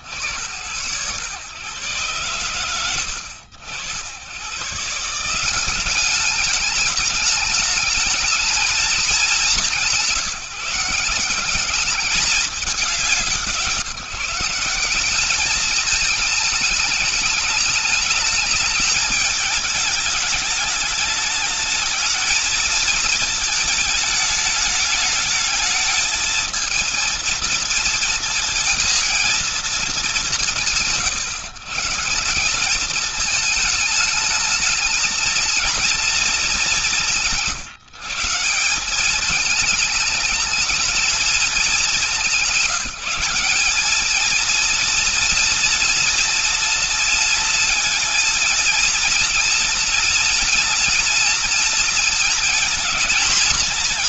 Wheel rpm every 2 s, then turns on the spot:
80, 90, 140, 210, 220, 160, 190, 180, 220, 210, 210, 220, 210, 230, 230, 130, 200, 220, 210, 180, 220, 200, 230, 230, 230, 230, 230.
none